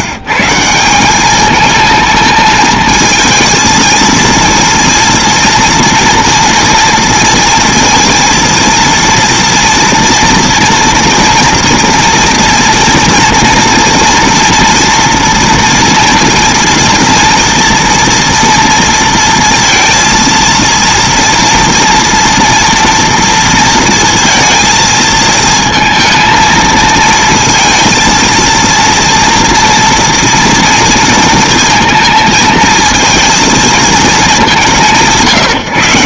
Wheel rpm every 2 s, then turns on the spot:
170, 220, 230, 230, 230, 230, 230, 230, 230, 230, 230, 230, 230, 220, 230, 230, 220, 170.
none